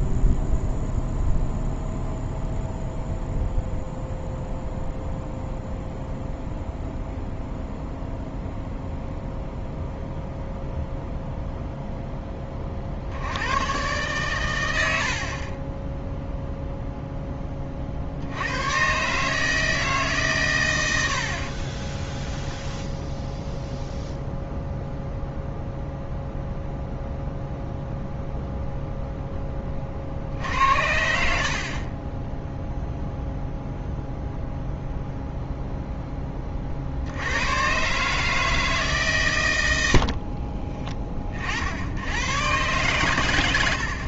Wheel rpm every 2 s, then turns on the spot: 0, 0, 0, 0, 0, 0, 30, 110, 0, 100, 110, 10, 0, 0, 0, 60, 0, 0, 40, 160, 30, 120.
22-24 40-42